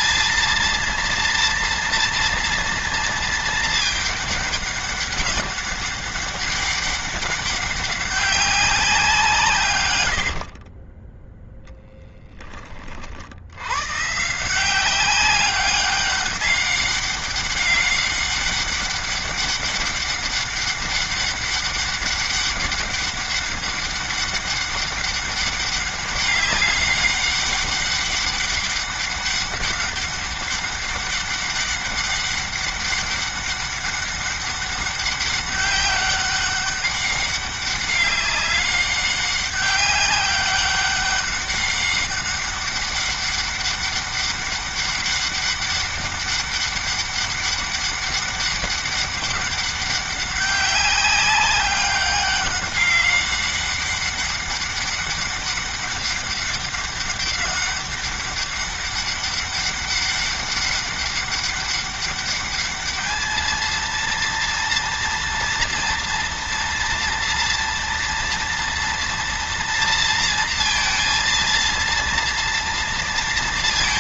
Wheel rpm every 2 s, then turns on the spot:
230, 230, 200, 200, 180, 30, 40, 180, 200, 200, 200, 200, 200, 200, 200, 200, 200, 200, 200, 190, 190, 200, 200, 200, 200, 190, 200, 200, 200, 200, 200, 210, 230, 230, 230, 230, 230.
10-12